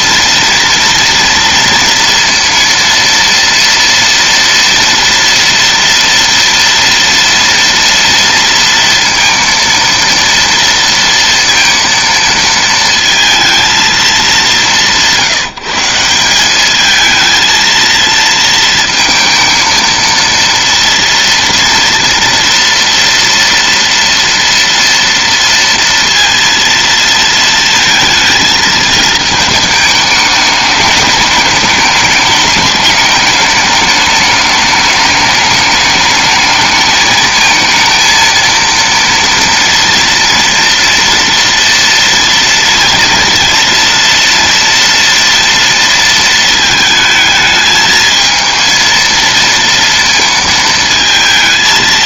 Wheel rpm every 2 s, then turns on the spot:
230, 230, 230, 230, 230, 230, 230, 180, 220, 220, 230, 230, 230, 220, 220, 210, 210, 210, 220, 230, 230, 230, 230, 220, 230, 220.
none